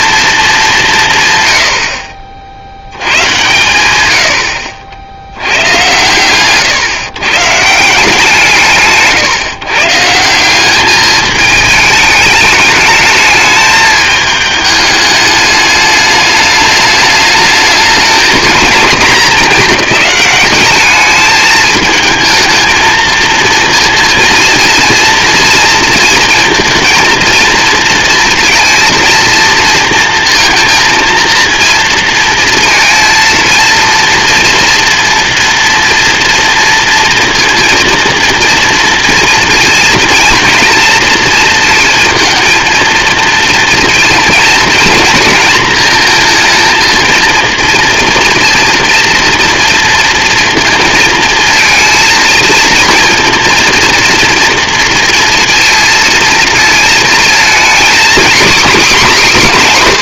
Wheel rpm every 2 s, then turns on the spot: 220, 60, 80, 130, 160, 180, 210, 210, 210, 230, 200, 220, 230, 230, 230, 230, 230, 230, 230, 230, 230, 220, 230, 230, 230, 230, 230, 230, 230, 250.
none